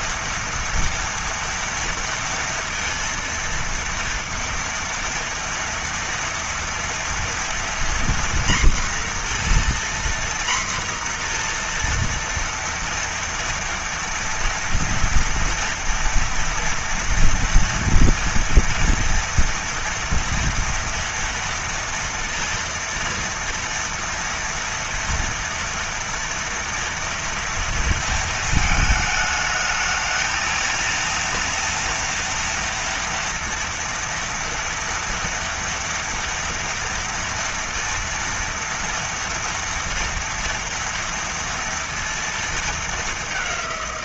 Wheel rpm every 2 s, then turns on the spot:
230, 230, 230, 230, 240, 240, 230, 230, 230, 240, 230, 230, 230, 230, 220, 230, 230, 230, 230, 230, 230, 210.
none